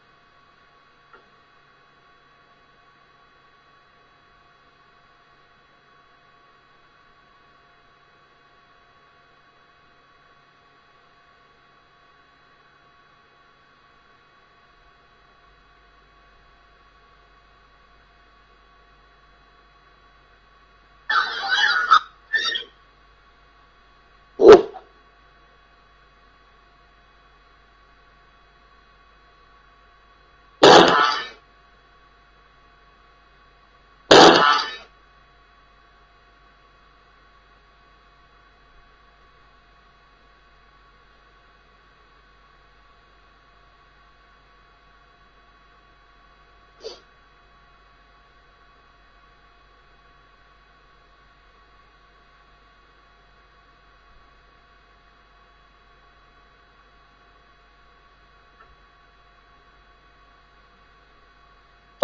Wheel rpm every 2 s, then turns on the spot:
0, 0, 0, 0, 0, 0, 0, 0, 0, 0, 0, 0, 0, 0, 0, 0, 0, 0, 0, 0, 0, 0, 0, 0, 0, 0, 0, 0, 0, 0, 0.
none